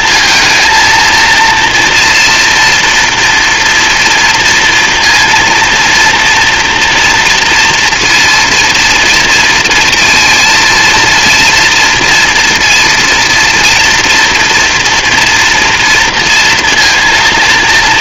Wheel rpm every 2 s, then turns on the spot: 230, 240, 230, 230, 230, 230, 230, 240, 230.
none